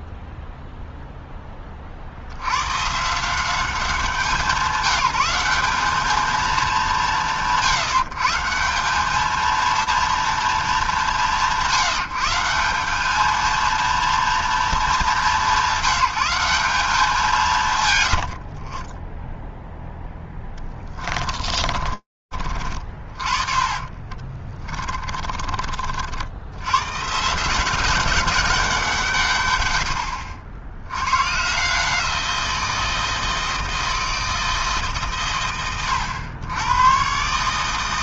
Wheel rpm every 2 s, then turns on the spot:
0, 100, 190, 180, 170, 190, 190, 210, 180, 50, 10, 40, 20, 100, 190, 90, 170, 160, 110.
18-22 24-26